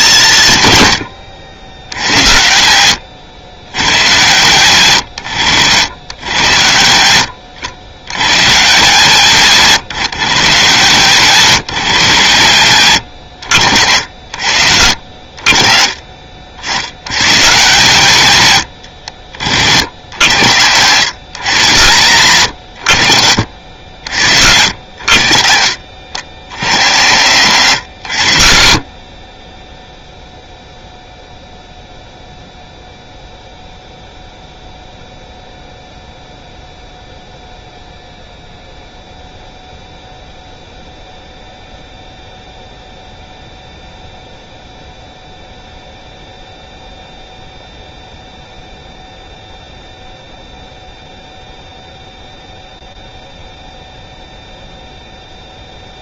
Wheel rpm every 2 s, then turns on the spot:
140, 90, 120, 100, 140, 150, 120, 70, 60, 100, 100, 110, 80, 80, 70, 0, 0, 0, 0, 0, 0, 0, 0, 0, 0, 0, 0, 0.
none